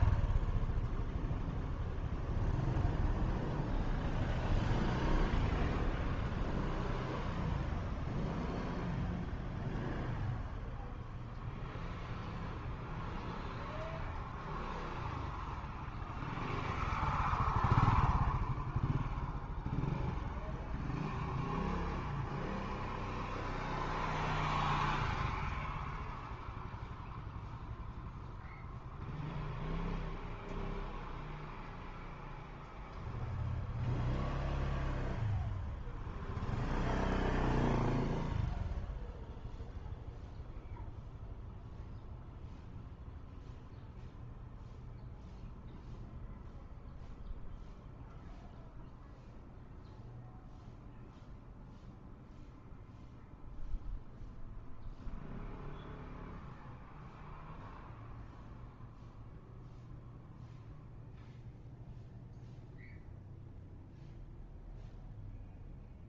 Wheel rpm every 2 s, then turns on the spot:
0, 0, 0, 0, 0, 0, 0, 0, 0, 0, 0, 0, 0, 0, 0, 0, 0, 0, 0, 0, 0, 0, 0, 0, 0, 0, 0, 0, 0, 0, 0, 0, 0.
none